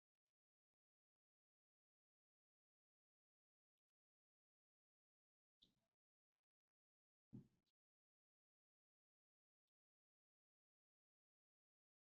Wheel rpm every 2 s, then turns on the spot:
0, 0, 0, 0, 0, 0.
none